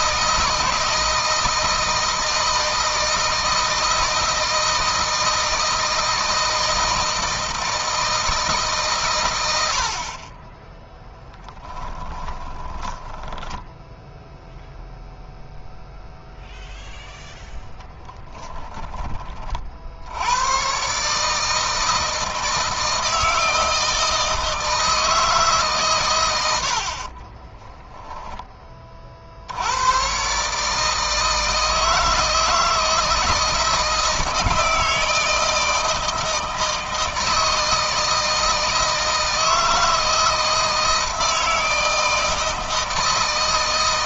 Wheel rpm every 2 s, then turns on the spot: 160, 160, 160, 160, 150, 20, 20, 0, 0, 10, 120, 160, 160, 70, 20, 150, 160, 160, 160, 160, 160, 160.
12-14 18-20 26-28